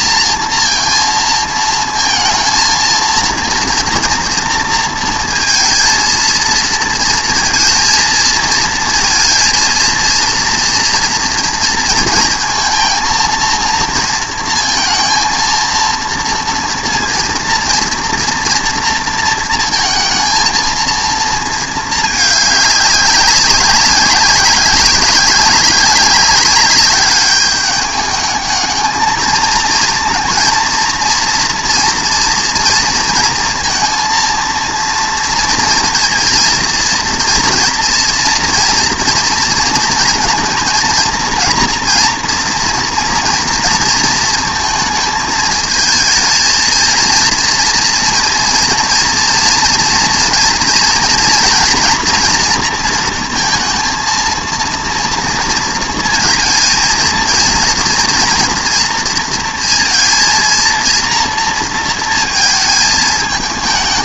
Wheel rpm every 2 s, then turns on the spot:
230, 230, 230, 230, 220, 230, 230, 230, 230, 230, 220, 200, 190, 200, 220, 230, 230, 230, 230, 230, 230, 230, 220, 220, 230, 230, 230, 230, 220, 240, 230, 220.
none